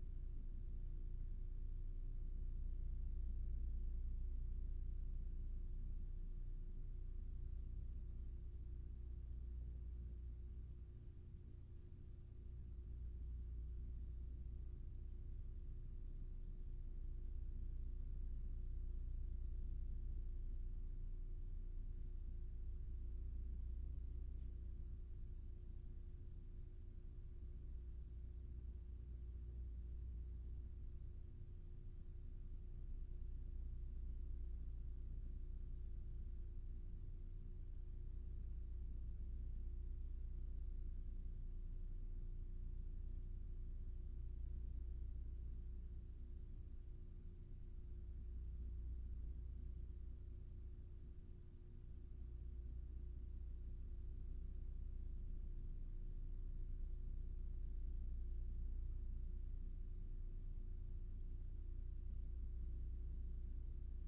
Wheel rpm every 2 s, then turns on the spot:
0, 0, 0, 0, 0, 0, 0, 0, 0, 0, 0, 0, 0, 0, 0, 0, 0, 0, 0, 0, 0, 0, 0, 0, 0, 0, 0, 0, 0, 0, 0, 0.
none